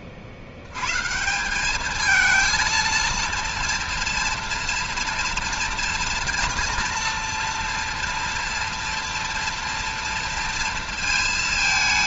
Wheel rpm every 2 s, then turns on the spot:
80, 220, 240, 230, 230, 230.
none